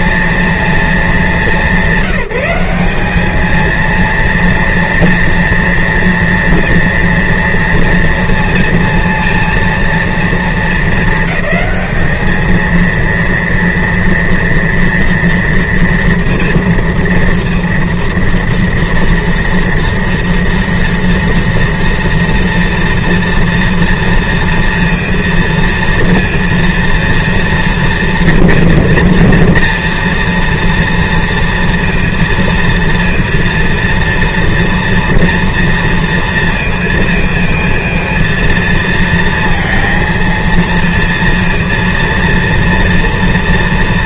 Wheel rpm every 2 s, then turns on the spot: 230, 190, 230, 230, 230, 210, 210, 230, 230, 230, 230, 240, 240, 230, 230, 230, 230, 230, 230, 230, 230, 230.
none